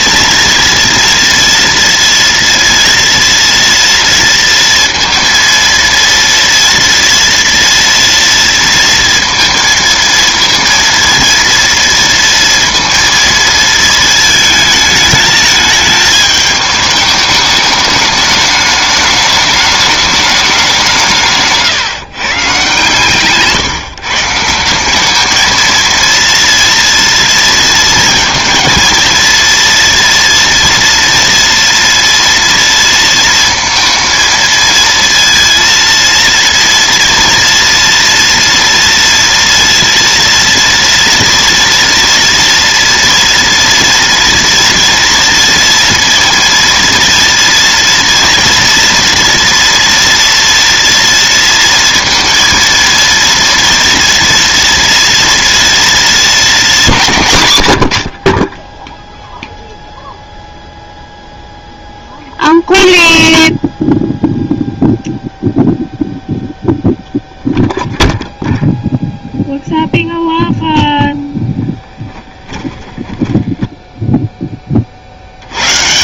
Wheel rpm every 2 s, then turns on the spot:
230, 230, 230, 230, 230, 230, 230, 220, 210, 210, 190, 140, 180, 230, 230, 230, 230, 230, 230, 240, 230, 230, 230, 230, 230, 230, 230, 230, 220, 20, 0, 0, 0, 0, 0, 0, 10, 20.
72-74